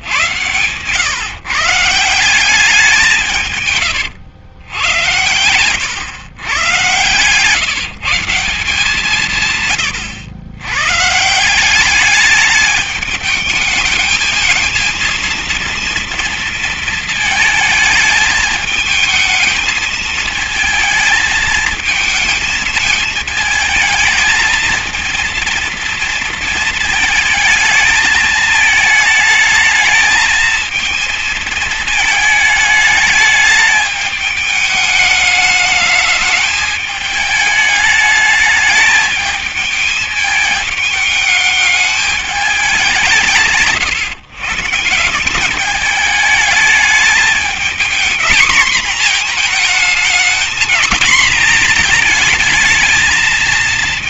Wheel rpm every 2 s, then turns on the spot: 120, 180, 100, 110, 170, 100, 210, 230, 230, 220, 220, 220, 220, 230, 220, 220, 220, 210, 210, 210, 220, 180, 140, 210, 230, 230, 220.
none